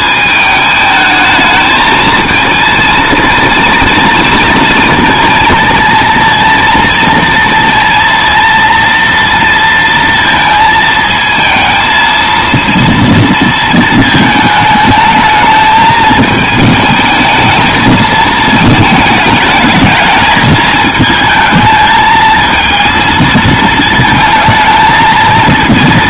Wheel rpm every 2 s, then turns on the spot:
210, 230, 230, 230, 230, 220, 230, 220, 220, 220, 220, 220, 220.
none